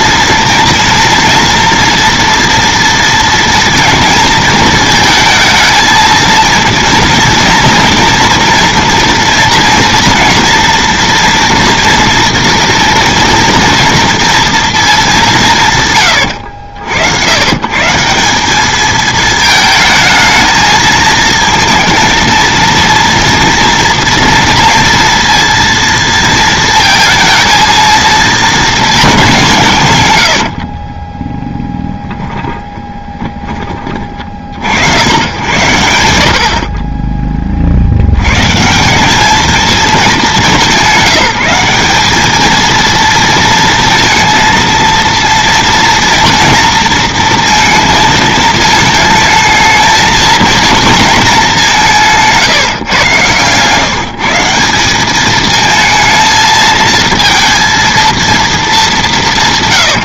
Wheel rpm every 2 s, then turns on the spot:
240, 230, 220, 230, 230, 230, 230, 220, 90, 210, 220, 230, 230, 230, 220, 50, 20, 70, 40, 150, 190, 220, 230, 230, 220, 230, 150, 180, 230, 220.
30-34